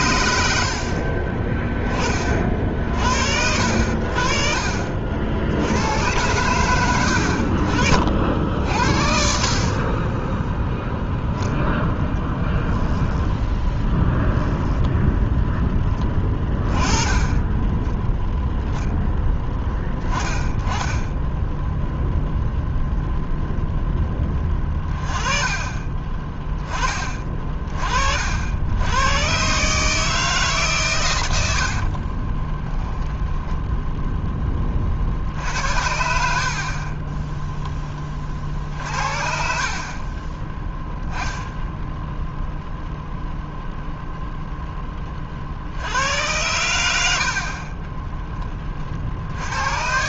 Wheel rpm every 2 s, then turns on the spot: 60, 50, 50, 90, 60, 0, 10, 10, 20, 0, 10, 0, 30, 20, 90, 120, 10, 40, 30, 60, 10, 0, 10, 90, 50.
14-16 32-34